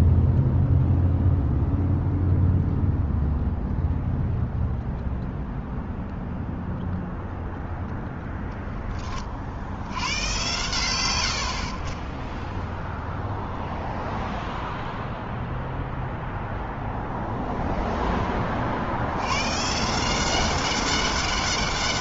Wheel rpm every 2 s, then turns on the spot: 0, 0, 0, 0, 40, 80, 0, 0, 0, 110, 200.
none